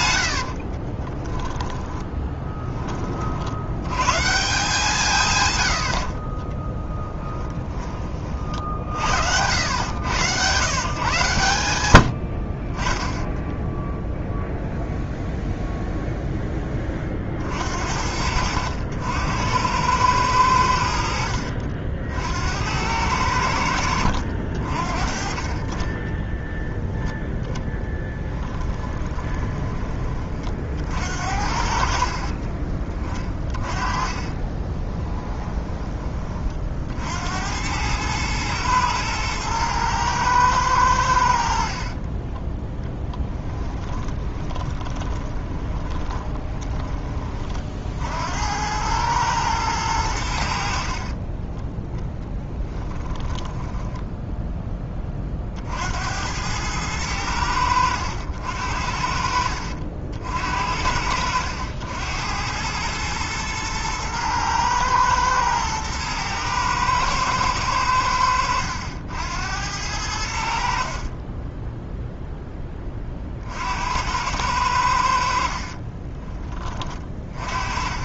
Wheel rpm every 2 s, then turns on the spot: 50, 10, 160, 20, 60, 130, 30, 0, 30, 80, 90, 80, 50, 0, 20, 40, 40, 20, 50, 110, 100, 10, 20, 20, 90, 60, 10, 10, 100, 70, 60, 100, 110, 120, 80, 60, 10, 90, 20.
0-2 6-8 28-30 32-36 44-46 52-54